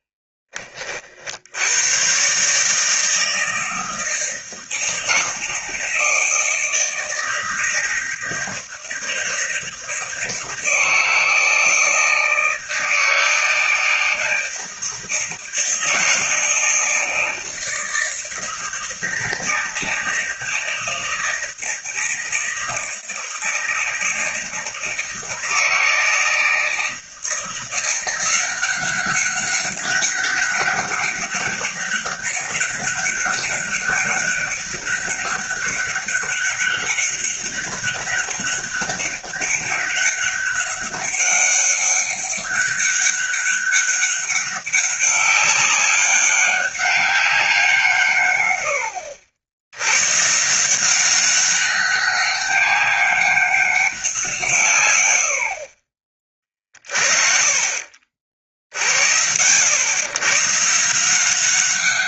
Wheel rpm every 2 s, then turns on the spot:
30, 150, 160, 160, 160, 160, 160, 160, 160, 160, 160, 160, 160, 160, 190, 200, 200, 200, 200, 200, 200, 200, 200, 200, 100, 170, 200, 140, 30, 50, 150.
none